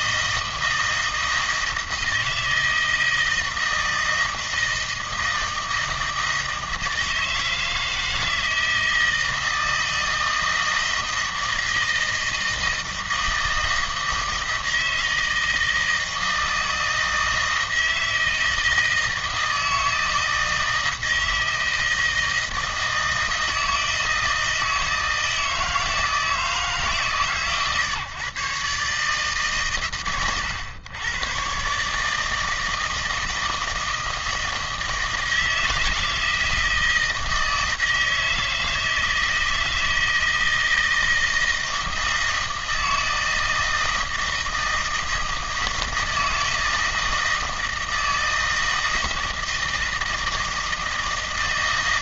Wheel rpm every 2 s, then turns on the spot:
160, 160, 160, 160, 160, 160, 160, 160, 160, 160, 160, 160, 160, 150, 140, 120, 160, 160, 160, 160, 160, 160, 160, 160, 160, 160.
none